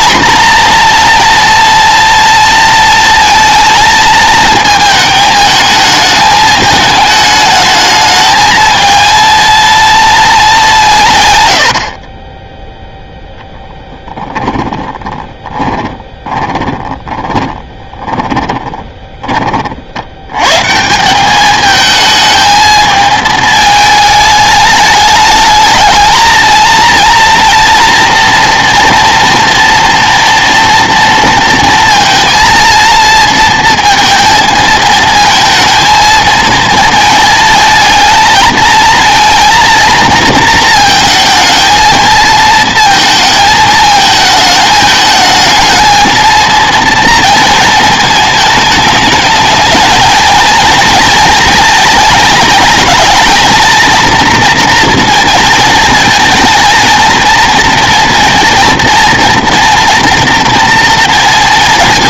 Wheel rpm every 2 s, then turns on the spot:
240, 230, 220, 210, 220, 200, 0, 10, 20, 20, 140, 220, 210, 230, 230, 230, 230, 220, 230, 220, 230, 220, 220, 230, 210, 230, 220, 230, 220, 230, 240.
14-20